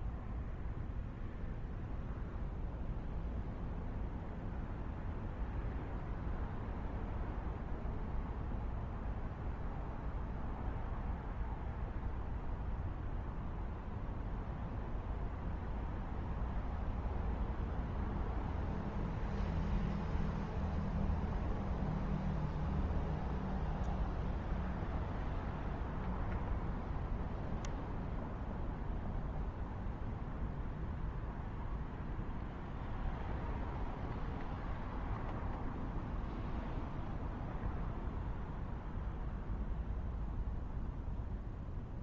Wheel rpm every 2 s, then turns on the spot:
0, 0, 0, 0, 0, 0, 0, 0, 0, 0, 0, 0, 0, 0, 0, 0, 0, 0, 0, 0, 0.
none